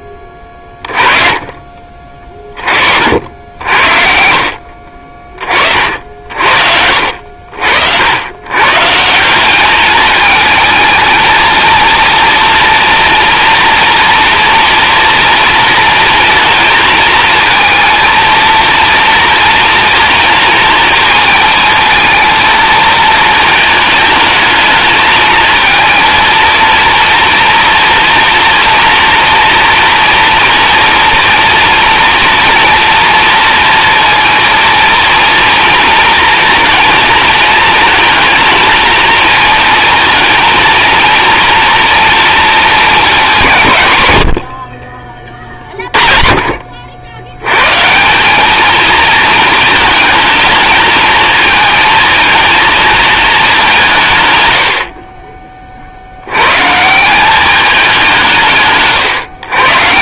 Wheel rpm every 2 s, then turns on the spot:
20, 40, 50, 70, 150, 220, 230, 230, 230, 230, 220, 220, 220, 230, 240, 230, 230, 230, 230, 220, 230, 220, 50, 50, 220, 220, 220, 80, 140, 150.
none